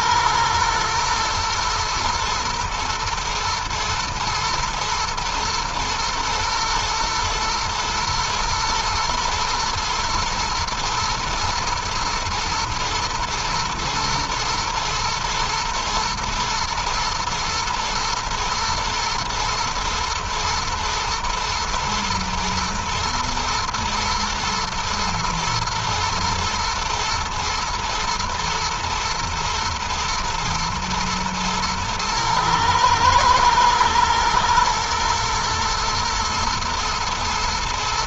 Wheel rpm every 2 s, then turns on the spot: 120, 120, 120, 110, 120, 110, 110, 110, 110, 120, 110, 110, 110, 110, 120, 120, 110, 120, 120.
none